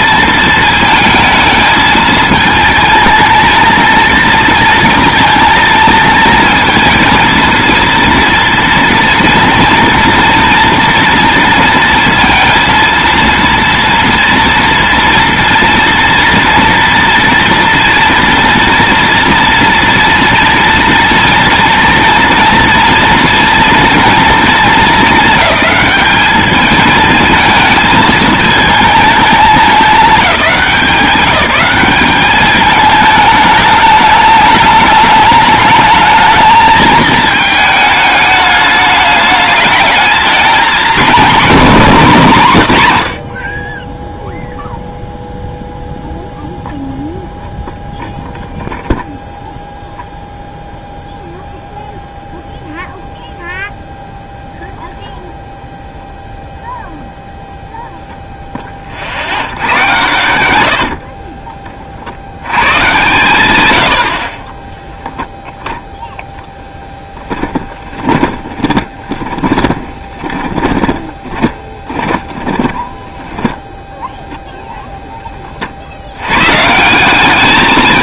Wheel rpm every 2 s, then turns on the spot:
220, 230, 230, 230, 230, 230, 230, 230, 230, 230, 230, 230, 210, 210, 220, 200, 210, 210, 220, 210, 230, 140, 0, 0, 0, 0, 0, 0, 0, 20, 80, 110, 10, 10, 20, 20, 10, 0, 140.
64-66 68-74